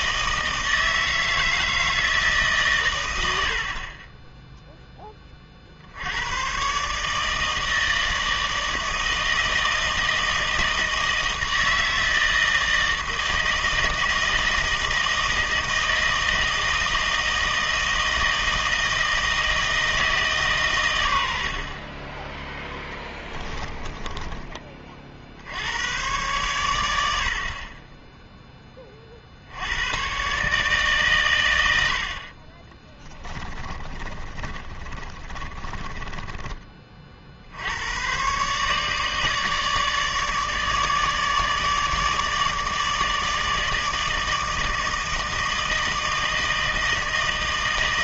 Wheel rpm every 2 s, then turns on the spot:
160, 120, 10, 130, 160, 160, 160, 160, 160, 160, 120, 10, 30, 100, 20, 140, 20, 40, 30, 150, 150, 150, 160, 160.
32-36